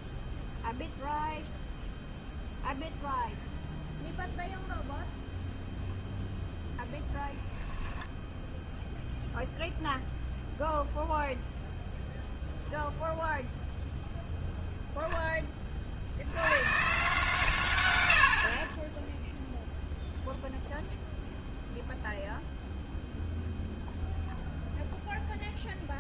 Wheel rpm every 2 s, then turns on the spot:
0, 0, 0, 10, 0, 0, 0, 0, 140, 10, 0, 0, 0.
6-8